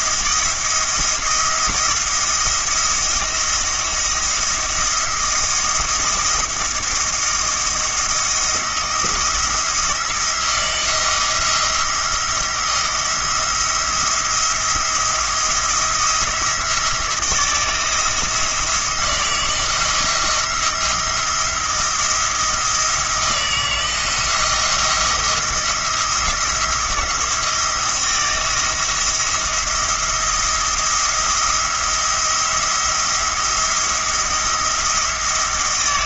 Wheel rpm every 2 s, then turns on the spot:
170, 170, 160, 170, 170, 160, 160, 170, 170, 160, 170, 160, 170, 170, 170, 170, 170, 170.
none